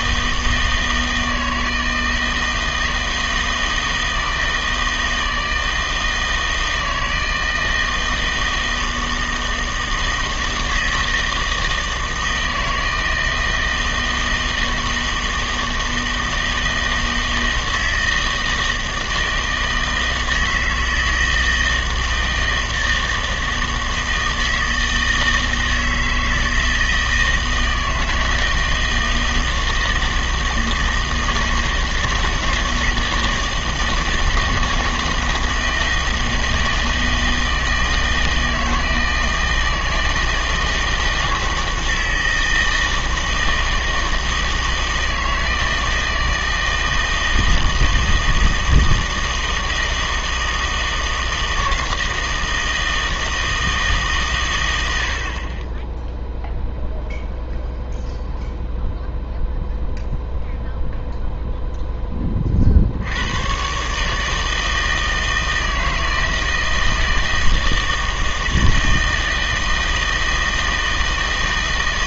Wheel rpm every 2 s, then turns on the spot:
160, 160, 160, 160, 160, 160, 160, 160, 160, 160, 160, 160, 160, 160, 160, 160, 160, 160, 160, 160, 160, 160, 160, 160, 160, 160, 170, 110, 0, 0, 0, 50, 160, 160, 160, 160.
none